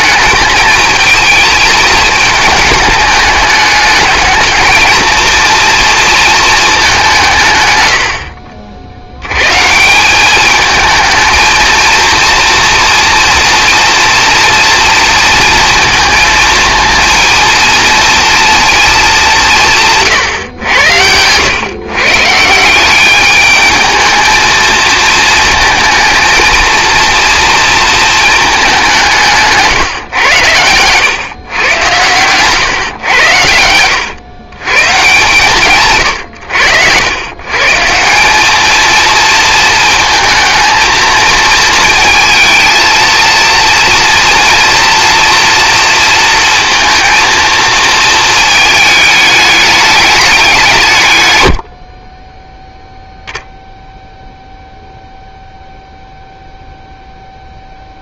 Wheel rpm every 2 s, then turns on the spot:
220, 220, 220, 220, 50, 210, 230, 240, 230, 230, 120, 160, 220, 230, 210, 100, 120, 130, 90, 210, 220, 230, 230, 230, 220, 190, 10, 0, 0.
20-22